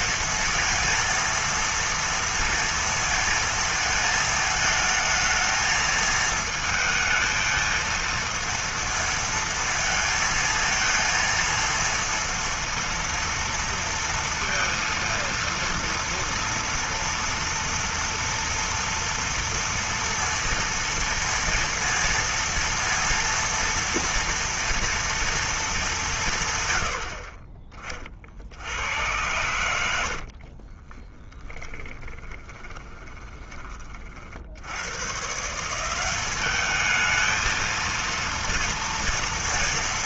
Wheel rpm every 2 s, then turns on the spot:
230, 230, 220, 220, 230, 230, 230, 230, 230, 230, 230, 230, 230, 90, 80, 30, 10, 100, 210, 230.
30-34